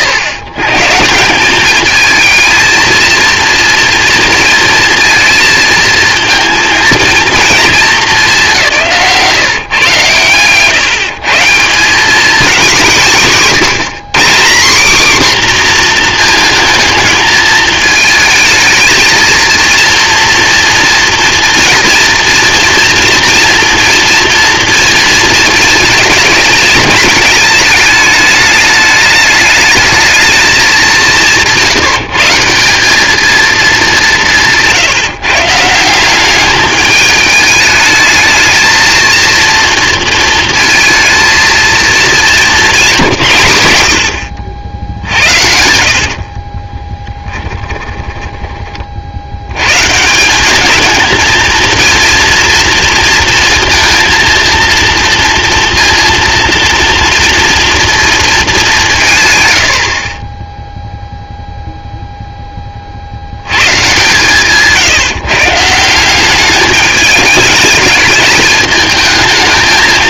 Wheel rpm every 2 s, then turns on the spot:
130, 230, 230, 230, 190, 130, 190, 230, 220, 220, 230, 230, 230, 220, 210, 210, 190, 160, 210, 230, 230, 190, 70, 30, 30, 210, 230, 230, 230, 180, 0, 20, 160, 210, 210.
34-36 42-44 46-48